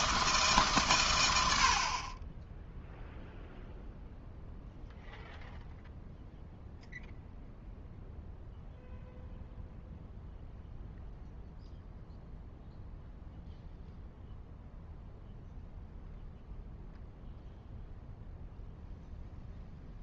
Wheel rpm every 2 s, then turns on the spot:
140, 0, 0, 0, 0, 0, 0, 0, 0, 0.
none